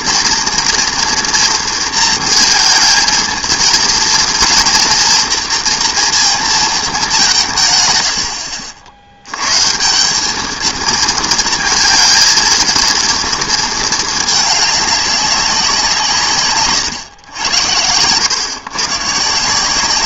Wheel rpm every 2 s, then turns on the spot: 230, 220, 230, 220, 70, 220, 230, 210, 130, 120.
16-18